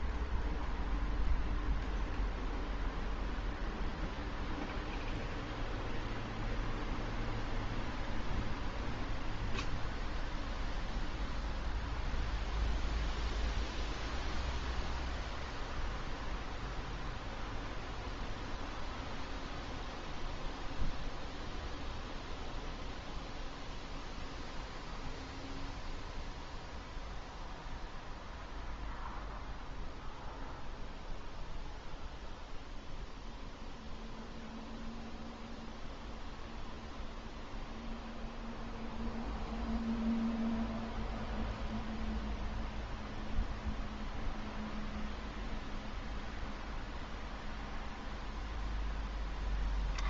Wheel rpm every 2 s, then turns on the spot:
0, 0, 0, 0, 0, 0, 0, 0, 0, 0, 0, 0, 0, 0, 0, 0, 0, 0, 0, 0, 0, 0, 0, 0, 0.
none